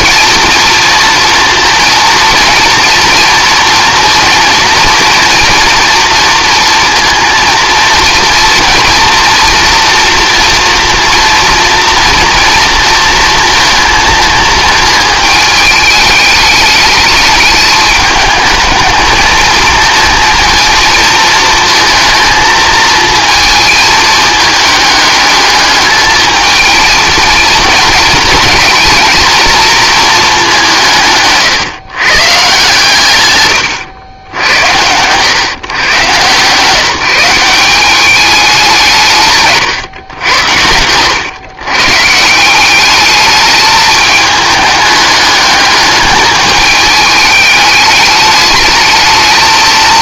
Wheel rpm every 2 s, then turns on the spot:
230, 240, 230, 230, 230, 230, 230, 220, 210, 220, 230, 220, 220, 220, 220, 180, 140, 90, 150, 190, 110, 190, 210, 210, 220.
none